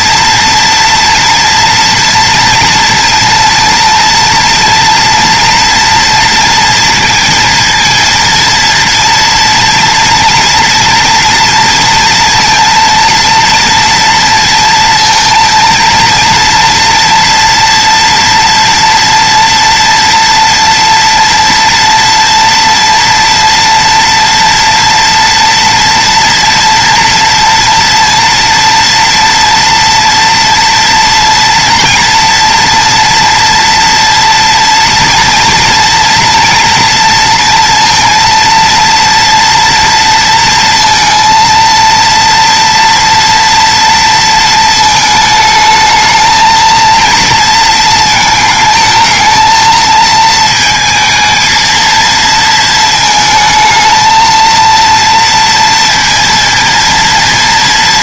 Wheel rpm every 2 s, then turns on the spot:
230, 230, 230, 230, 230, 230, 230, 230, 230, 230, 230, 230, 230, 240, 230, 240, 230, 230, 230, 230, 230, 230, 220, 230, 220, 220, 220, 230, 230.
none